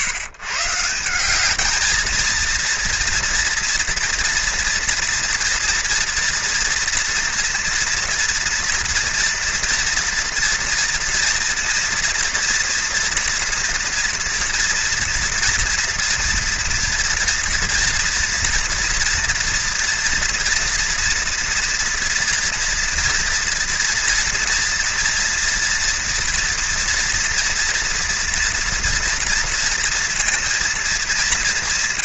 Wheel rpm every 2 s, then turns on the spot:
170, 230, 240, 230, 230, 230, 230, 230, 230, 230, 230, 230, 230, 230, 230, 220.
none